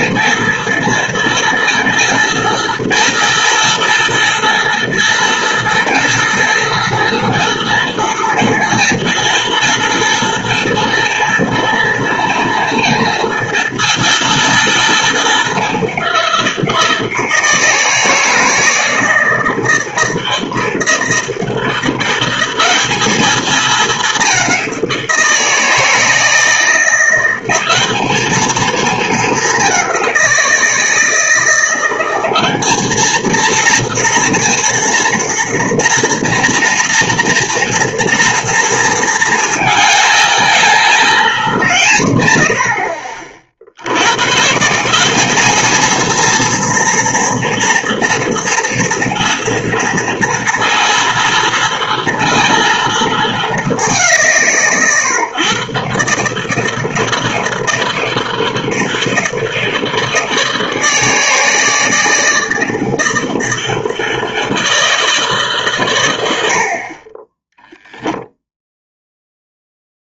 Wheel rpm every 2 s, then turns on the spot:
230, 230, 230, 230, 230, 230, 230, 230, 180, 160, 160, 190, 190, 170, 220, 170, 200, 230, 230, 230, 220, 90, 130, 230, 230, 230, 230, 160, 150, 160, 160, 160, 160, 60, 0.
none